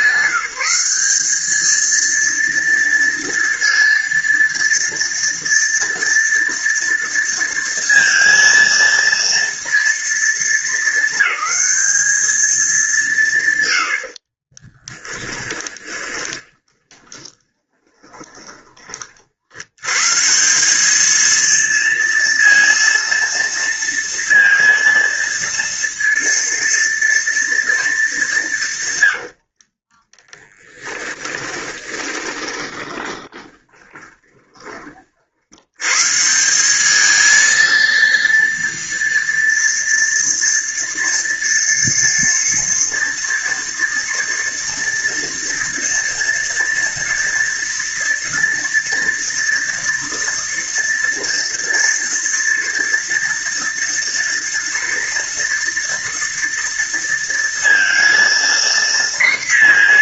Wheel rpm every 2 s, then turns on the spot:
180, 230, 230, 230, 230, 220, 210, 30, 10, 20, 170, 230, 230, 230, 160, 20, 20, 20, 180, 230, 240, 230, 230, 230, 230, 240, 230, 230, 230, 230.
14-20 30-34